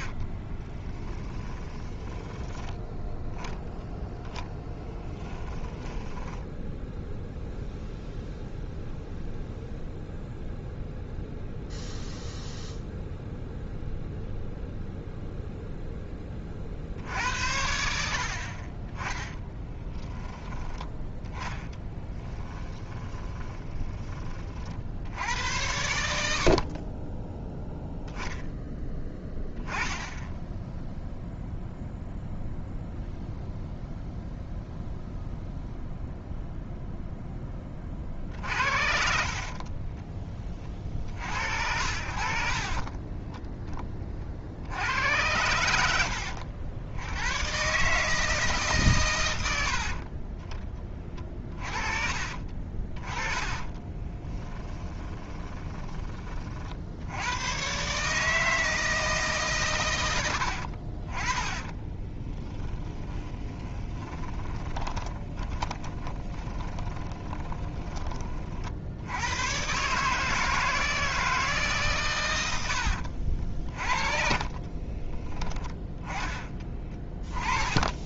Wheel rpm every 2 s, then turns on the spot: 10, 10, 10, 0, 0, 0, 0, 0, 60, 20, 10, 20, 60, 30, 10, 0, 0, 0, 0, 60, 60, 20, 80, 90, 120, 30, 30, 20, 70, 160, 60, 20, 20, 20, 70, 160, 70, 30, 20.
0-2 4-6 22-24 38-40 42-44 52-56 60-68 72-78